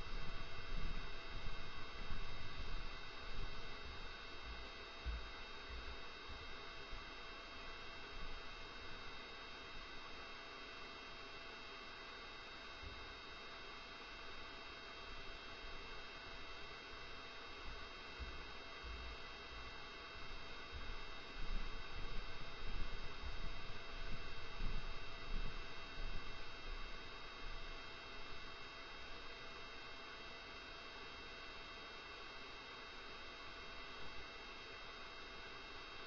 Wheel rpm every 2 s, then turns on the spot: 0, 0, 0, 0, 0, 0, 0, 0, 0, 0, 0, 0, 0, 0, 0, 0, 0, 0.
none